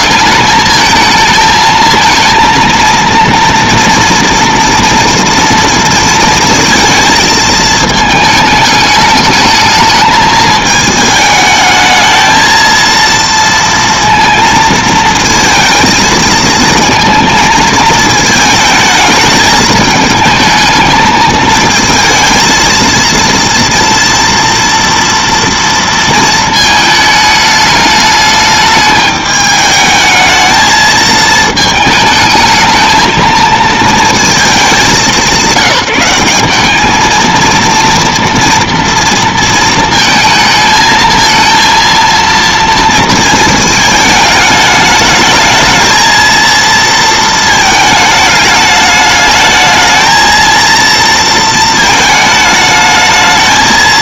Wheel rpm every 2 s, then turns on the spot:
220, 230, 230, 230, 210, 220, 220, 230, 230, 220, 220, 230, 230, 220, 210, 220, 220, 210, 210, 230, 220, 230, 210, 230, 210, 230, 220.
none